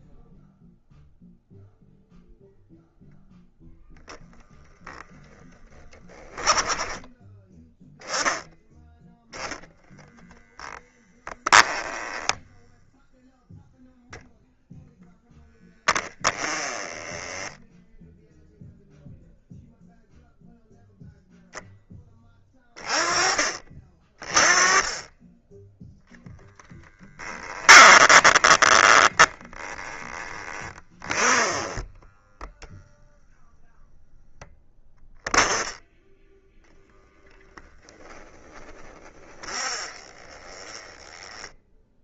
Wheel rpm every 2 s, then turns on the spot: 0, 0, 10, 10, 0, 0, 0, 0, 10, 0, 0, 30, 20, 10, 10, 20, 0, 10, 10, 20, 10.
4-6 16-18 26-32 38-42